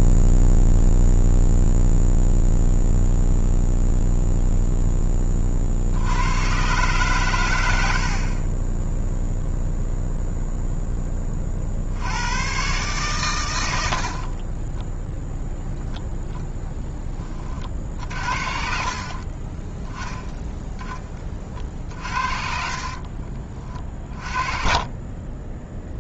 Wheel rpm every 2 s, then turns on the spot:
0, 0, 0, 70, 60, 0, 100, 30, 10, 50, 10, 40, 30.
14-16 22-24